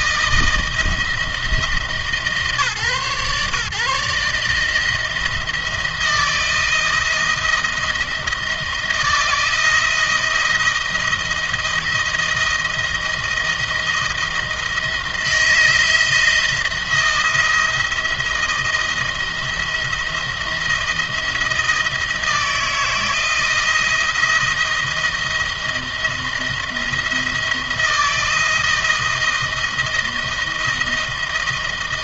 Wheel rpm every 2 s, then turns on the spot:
160, 140, 150, 160, 170, 160, 170, 160, 170, 170, 170, 160, 170, 170, 170, 170.
none